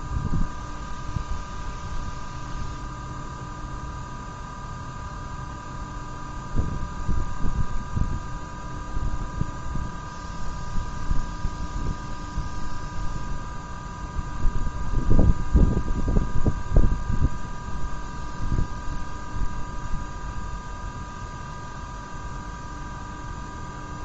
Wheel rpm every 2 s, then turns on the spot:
0, 0, 0, 0, 0, 0, 0, 0, 0, 0, 0, 0.
none